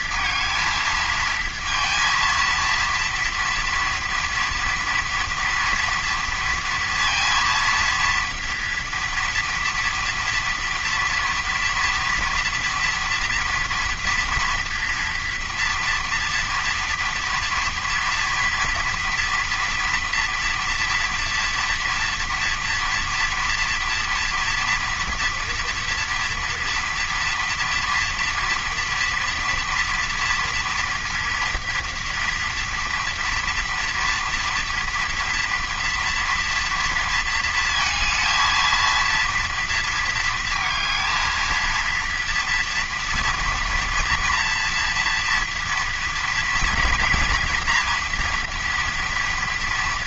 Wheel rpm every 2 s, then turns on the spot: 230, 230, 230, 230, 230, 230, 230, 230, 230, 230, 240, 240, 230, 230, 230, 230, 230, 230, 230, 230, 220, 230, 240, 230, 230.
none